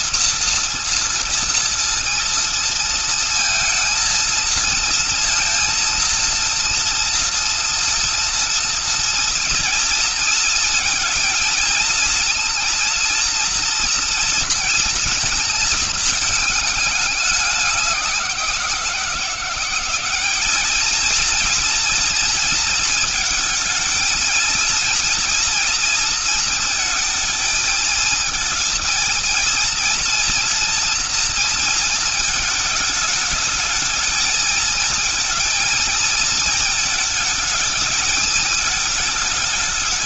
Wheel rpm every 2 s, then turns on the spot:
230, 230, 230, 230, 230, 220, 230, 230, 210, 180, 220, 230, 230, 220, 230, 230, 220, 220, 220, 210.
none